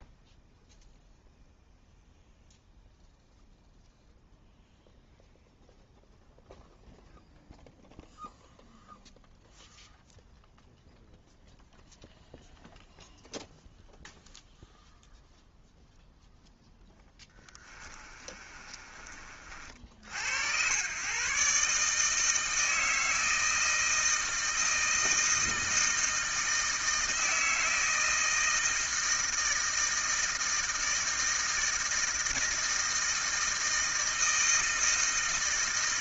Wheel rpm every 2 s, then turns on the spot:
0, 0, 0, 0, 0, 0, 0, 0, 0, 30, 110, 160, 160, 160, 160, 160, 160, 160.
18-20